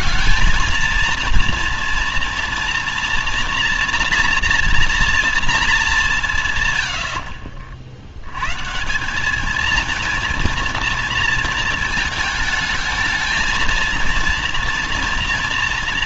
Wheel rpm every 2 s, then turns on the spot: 220, 230, 240, 150, 140, 230, 220, 230.
none